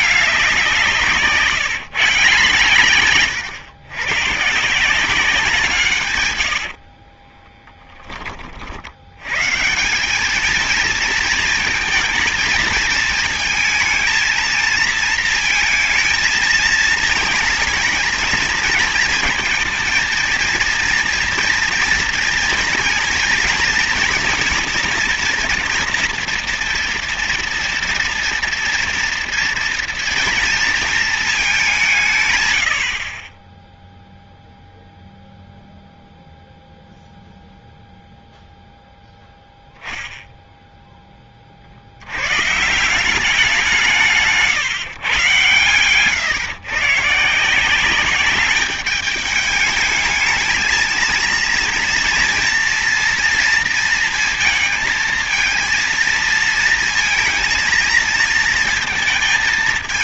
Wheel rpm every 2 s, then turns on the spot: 170, 140, 150, 80, 60, 230, 230, 230, 220, 220, 230, 230, 230, 230, 240, 230, 100, 0, 0, 0, 10, 150, 150, 130, 210, 220, 230, 230, 230, 230.
6-8